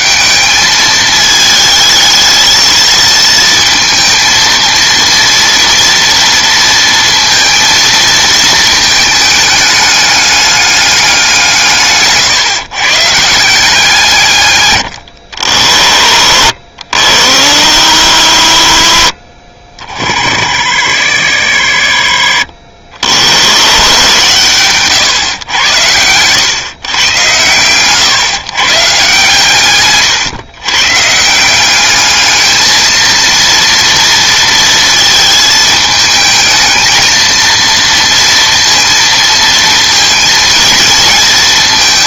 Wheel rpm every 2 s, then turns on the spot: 210, 220, 230, 230, 220, 200, 140, 120, 60, 80, 60, 50, 120, 120, 130, 130, 220, 230, 220, 230, 230.
none